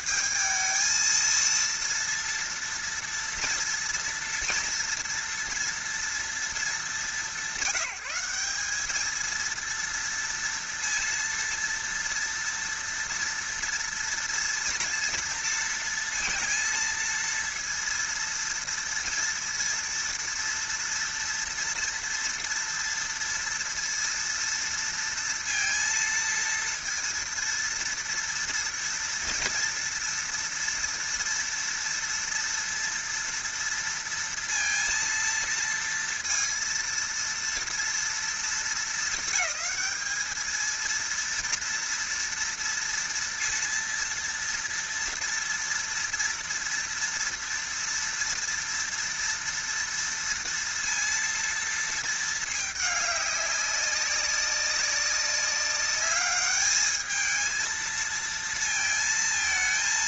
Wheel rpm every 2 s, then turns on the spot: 220, 230, 240, 210, 190, 230, 230, 230, 230, 230, 230, 230, 230, 230, 230, 230, 230, 230, 230, 230, 220, 230, 240, 230, 230, 230, 220, 200, 210, 230.
none